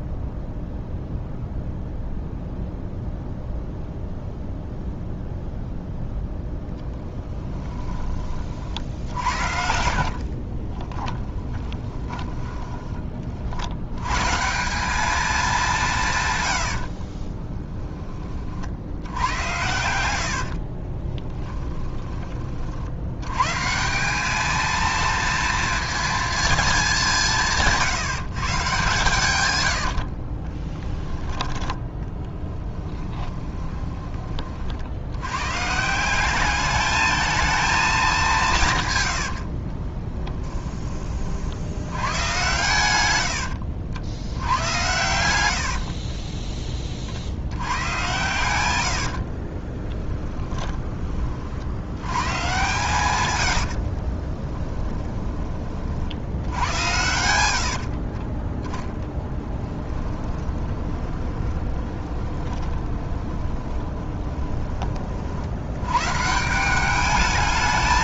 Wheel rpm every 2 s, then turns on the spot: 0, 0, 0, 0, 50, 20, 20, 180, 70, 70, 40, 50, 230, 210, 130, 10, 20, 50, 210, 130, 20, 110, 100, 20, 90, 20, 130, 10, 90, 10, 20, 20, 30, 190.
8-12 16-18 20-22 32-34 44-46 48-50 54-56 60-64